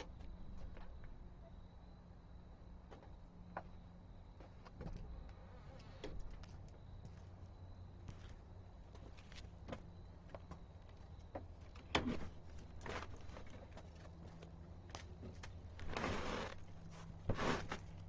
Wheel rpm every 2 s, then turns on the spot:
0, 0, 0, 0, 0, 0, 0, 0, 0.
none